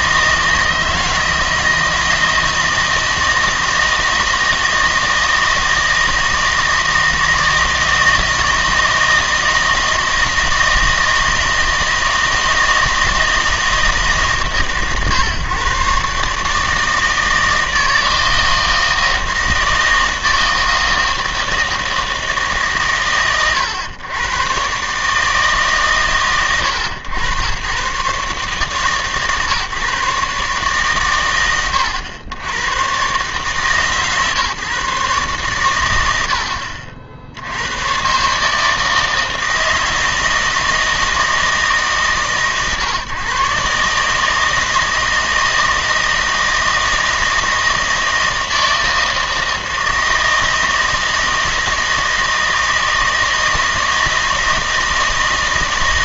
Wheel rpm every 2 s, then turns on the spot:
160, 160, 160, 160, 160, 160, 160, 130, 160, 160, 160, 140, 130, 110, 140, 140, 110, 140, 60, 160, 160, 140, 160, 160, 160, 160, 160, 160.
none